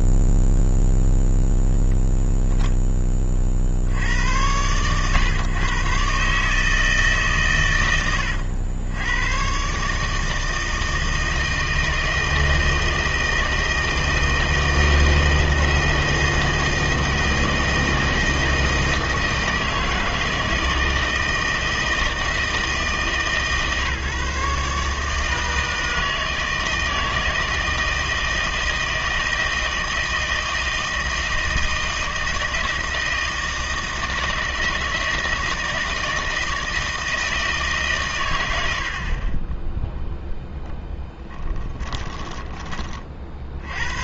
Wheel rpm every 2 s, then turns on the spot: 0, 0, 110, 150, 100, 160, 160, 160, 160, 160, 160, 160, 150, 160, 160, 160, 160, 160, 160, 110, 10, 20.
42-44